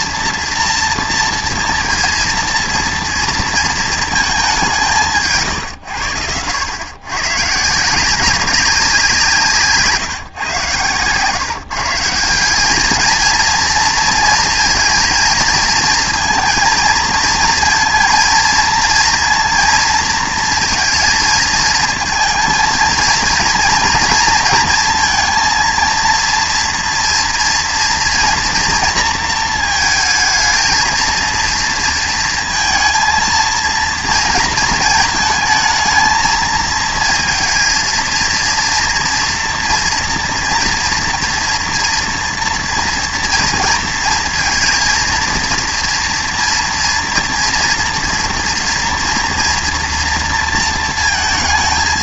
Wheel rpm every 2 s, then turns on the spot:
230, 230, 200, 100, 190, 130, 190, 230, 230, 230, 230, 230, 230, 230, 230, 220, 230, 220, 220, 230, 230, 230, 230, 230, 230, 230.
none